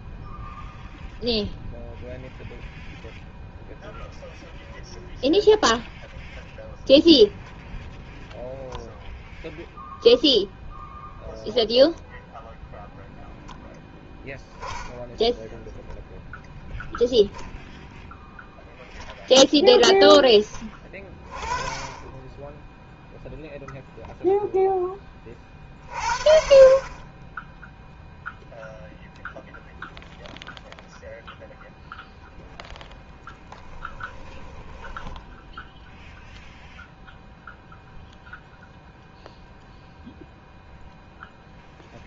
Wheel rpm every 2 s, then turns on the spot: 0, 0, 0, 0, 0, 0, 0, 0, 10, 0, 20, 0, 20, 40, 0, 0, 0, 10, 0, 0, 0.
34-36